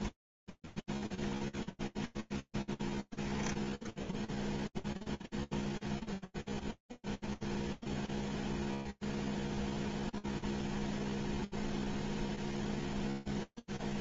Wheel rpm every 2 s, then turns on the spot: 0, 0, 0, 0, 0, 0, 0.
none